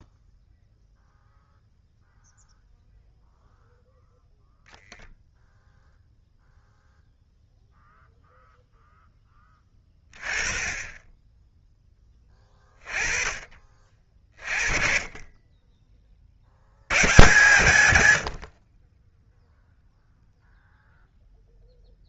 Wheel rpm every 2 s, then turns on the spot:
0, 0, 0, 0, 0, 20, 20, 30, 80, 30, 0.
none